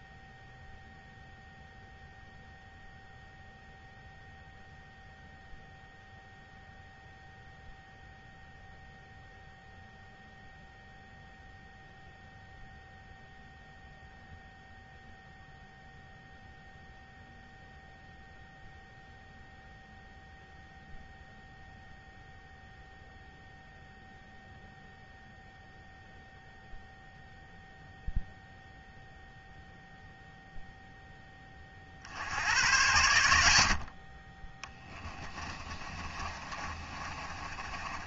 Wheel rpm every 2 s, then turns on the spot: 0, 0, 0, 0, 0, 0, 0, 0, 0, 0, 0, 0, 0, 0, 0, 0, 90, 20, 30.
34-38